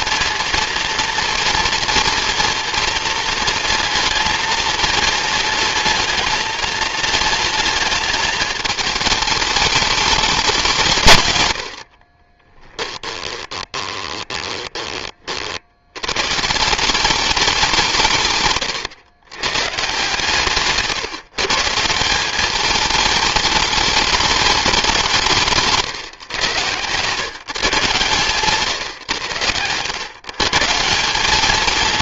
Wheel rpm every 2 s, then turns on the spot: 230, 230, 220, 220, 220, 170, 20, 20, 160, 120, 150, 210, 200, 120, 130, 180.
12-14 26-28